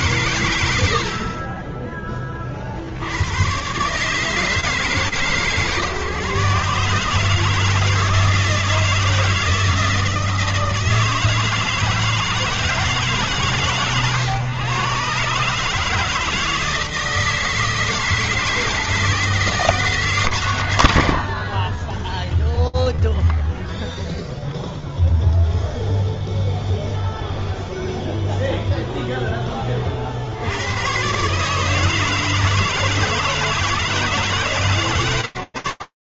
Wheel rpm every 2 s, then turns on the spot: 140, 50, 150, 130, 160, 160, 160, 130, 160, 160, 120, 10, 0, 0, 0, 130, 160, 140.
none